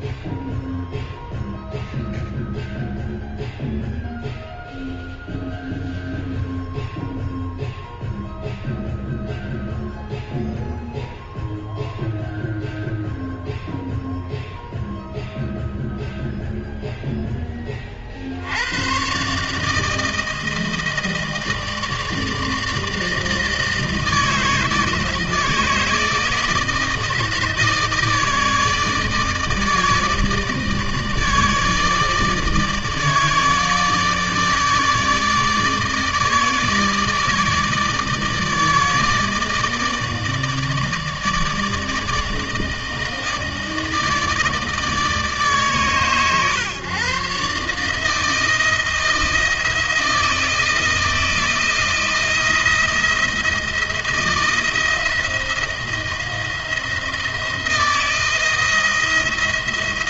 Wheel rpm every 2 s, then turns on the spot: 0, 0, 0, 0, 0, 0, 0, 0, 0, 120, 160, 160, 160, 160, 150, 160, 150, 150, 160, 150, 150, 160, 150, 130, 160, 160, 160, 170, 160, 170.
none